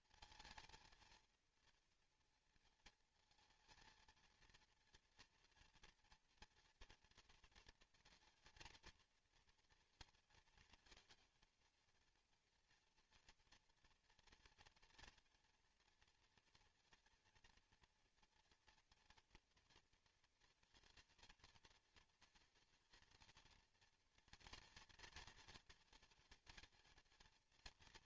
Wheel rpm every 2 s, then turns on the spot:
230, 230, 230, 240, 230, 220, 230, 230, 230, 230, 230, 230, 230, 220.
none